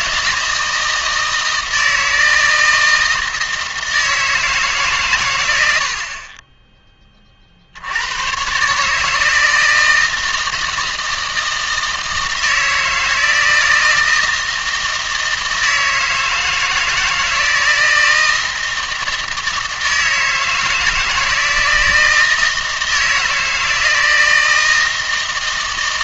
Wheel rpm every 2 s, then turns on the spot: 160, 160, 140, 20, 140, 160, 160, 160, 160, 160, 160, 160, 160.
none